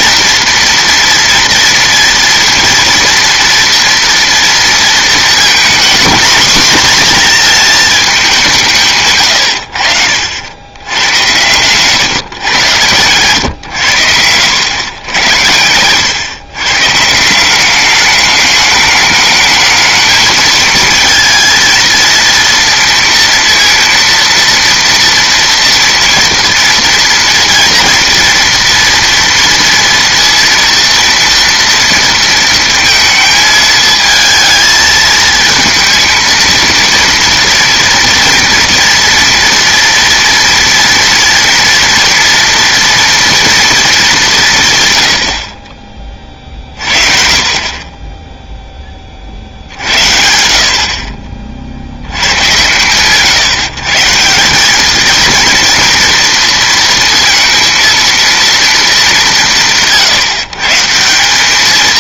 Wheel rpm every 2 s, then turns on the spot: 230, 230, 230, 230, 150, 90, 120, 110, 140, 210, 220, 230, 240, 230, 240, 230, 220, 220, 230, 230, 230, 240, 130, 40, 10, 60, 110, 200, 230, 230, 150.
none